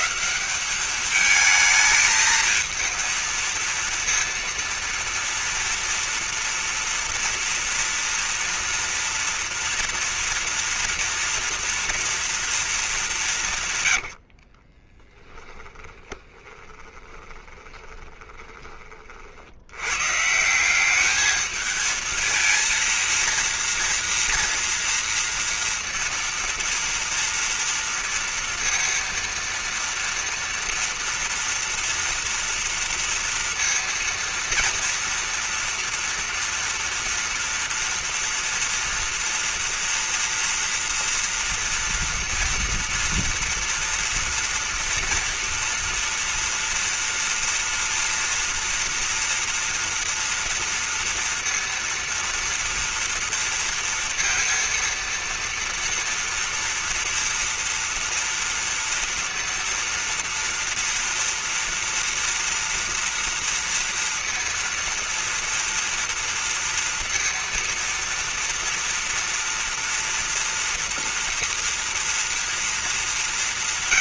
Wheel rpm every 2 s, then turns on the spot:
170, 220, 230, 230, 230, 230, 230, 50, 20, 20, 170, 230, 230, 240, 230, 230, 230, 230, 230, 230, 230, 230, 230, 230, 230, 230, 230, 230, 230, 230, 240, 230, 230, 230, 240, 230, 230.
14-18